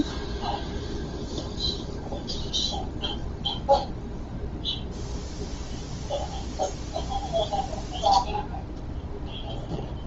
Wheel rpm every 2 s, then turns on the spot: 0, 0, 0, 0, 0.
none